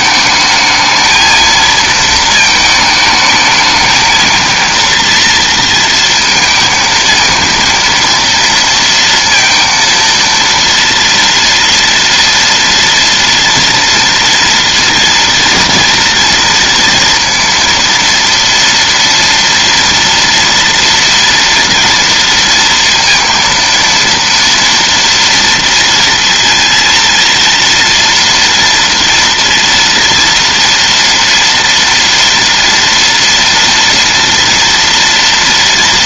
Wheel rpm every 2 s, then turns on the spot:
220, 220, 230, 220, 230, 230, 230, 230, 230, 230, 230, 230, 230, 230, 230, 230, 230, 230.
none